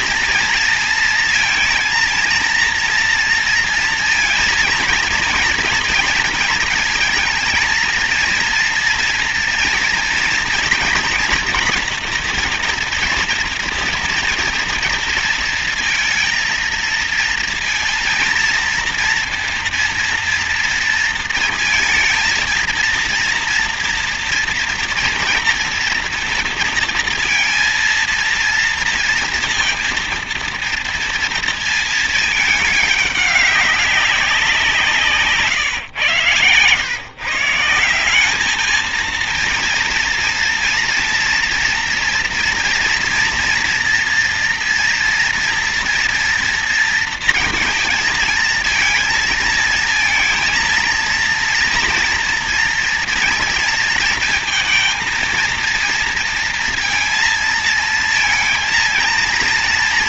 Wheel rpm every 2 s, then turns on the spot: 230, 230, 230, 230, 230, 240, 240, 230, 230, 230, 230, 230, 230, 230, 230, 230, 210, 170, 120, 220, 230, 230, 230, 230, 220, 230, 230, 230, 230, 230.
none